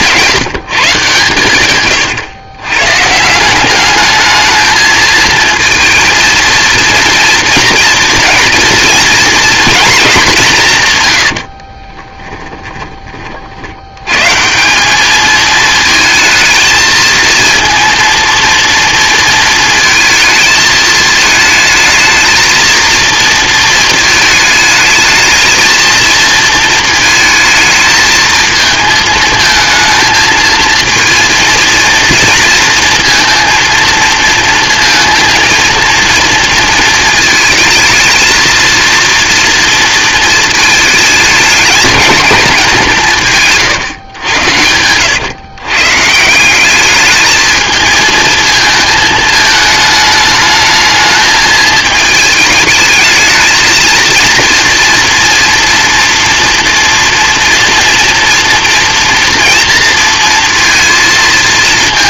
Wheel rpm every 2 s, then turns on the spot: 120, 170, 220, 230, 240, 90, 30, 210, 220, 230, 220, 230, 220, 220, 220, 230, 230, 230, 220, 230, 220, 160, 110, 210, 220, 220, 220, 230, 230, 230, 230.
10-12